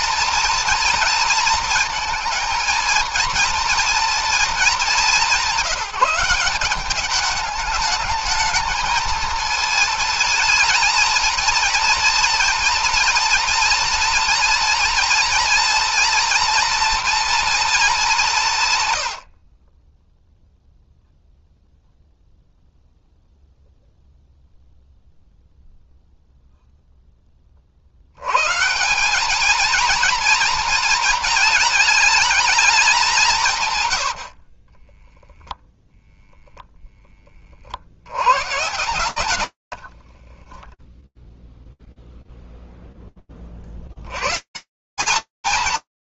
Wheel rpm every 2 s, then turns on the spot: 230, 230, 180, 210, 220, 230, 230, 230, 230, 40, 0, 0, 0, 10, 180, 220, 190, 10, 20, 90, 0, 10, 170.
34-36 38-40